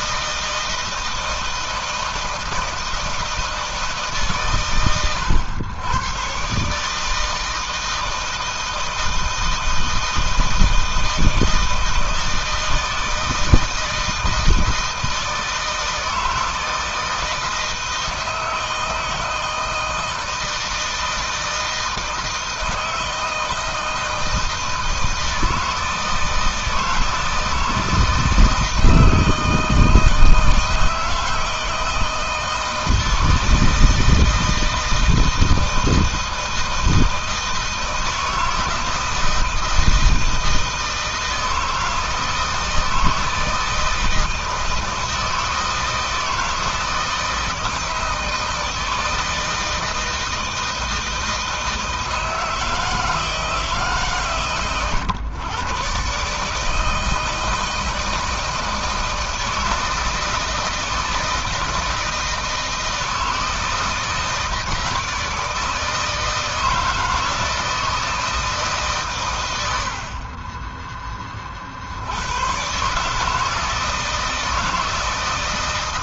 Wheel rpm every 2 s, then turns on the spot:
160, 160, 130, 130, 160, 160, 160, 160, 160, 160, 160, 160, 160, 160, 160, 160, 160, 160, 160, 160, 160, 160, 160, 160, 160, 160, 160, 130, 150, 160, 160, 160, 160, 160, 150, 20, 120, 160.
none